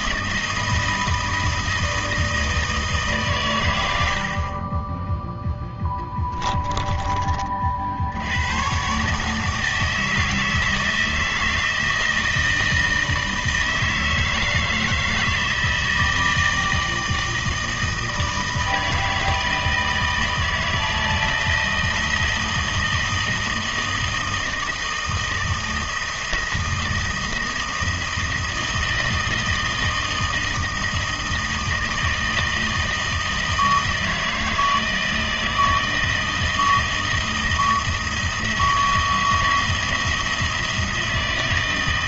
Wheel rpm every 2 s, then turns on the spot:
160, 160, 20, 20, 120, 160, 160, 160, 160, 160, 160, 160, 160, 160, 170, 160, 160, 160, 160, 170, 170.
4-8